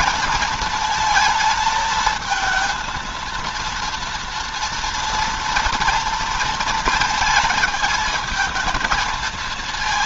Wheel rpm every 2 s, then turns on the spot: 220, 230, 230, 230, 220.
none